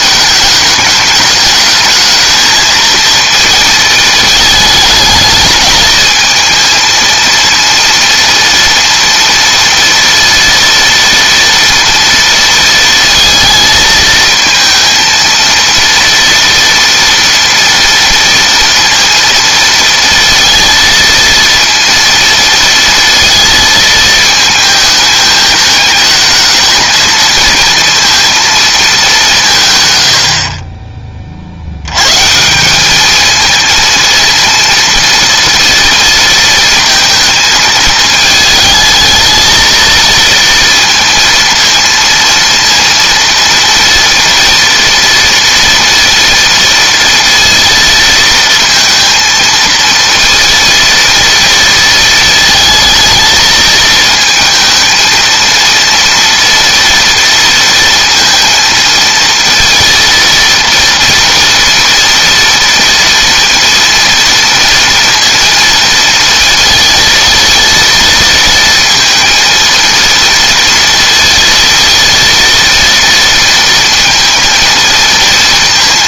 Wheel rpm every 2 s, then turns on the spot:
210, 220, 220, 230, 230, 230, 230, 230, 230, 230, 230, 230, 220, 220, 220, 40, 190, 230, 220, 220, 230, 230, 230, 230, 230, 230, 220, 220, 230, 230, 230, 230, 230, 230, 230, 230, 230, 230.
none